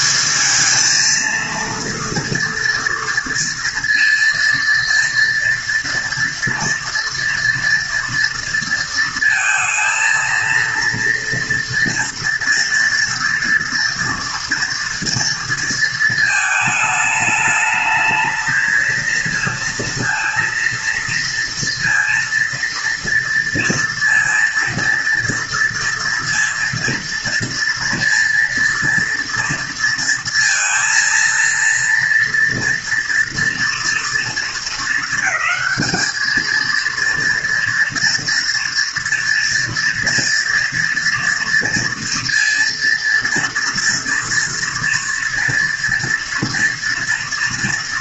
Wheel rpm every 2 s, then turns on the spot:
220, 230, 230, 230, 230, 230, 230, 230, 220, 230, 230, 230, 230, 230, 230, 230, 230, 220, 230, 240, 240, 230, 230, 230.
none